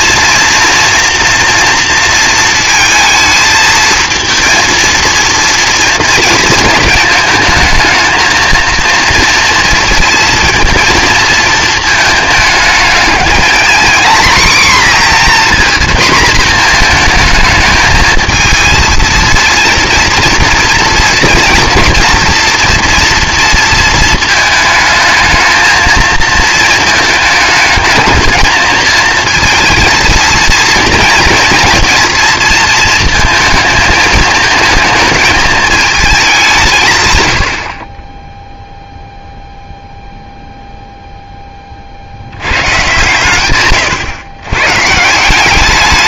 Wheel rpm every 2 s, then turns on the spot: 230, 230, 230, 220, 230, 230, 210, 250, 230, 230, 230, 240, 220, 220, 220, 230, 230, 230, 160, 0, 0, 110, 140.
none